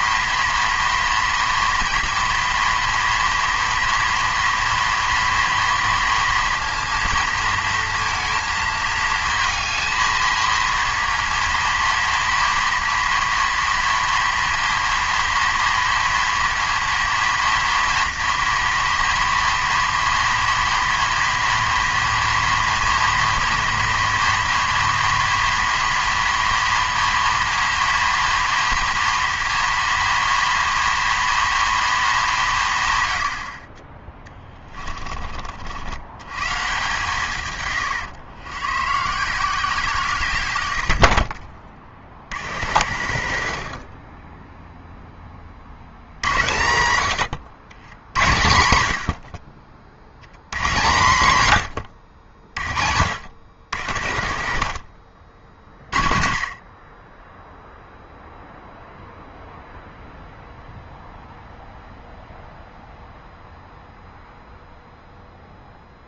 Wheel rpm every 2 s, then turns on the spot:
230, 230, 230, 230, 220, 230, 230, 230, 230, 230, 230, 230, 230, 230, 230, 230, 140, 30, 150, 120, 90, 90, 0, 90, 90, 110, 50, 60, 30, 0, 0, 0, 0.
34-36 42-44 54-56